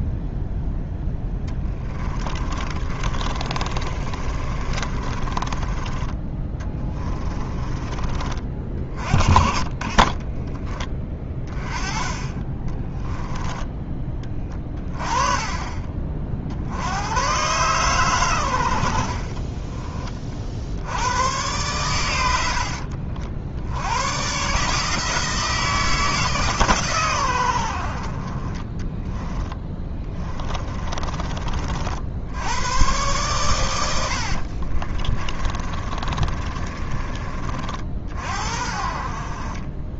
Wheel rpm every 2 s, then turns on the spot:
0, 30, 30, 20, 30, 20, 20, 30, 80, 70, 70, 60, 150, 140, 10, 30, 110, 40, 30, 50.
2-8 12-14 28-32 34-38